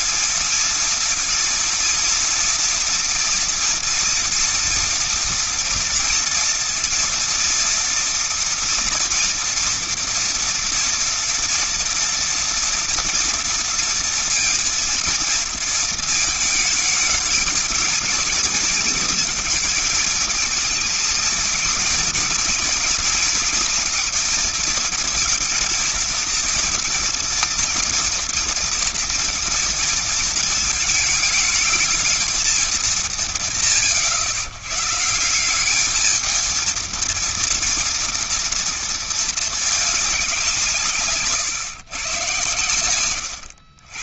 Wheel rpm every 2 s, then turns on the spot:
230, 230, 230, 230, 230, 230, 230, 230, 220, 220, 220, 240, 220, 230, 230, 220, 220, 110, 220, 230, 190, 130.
none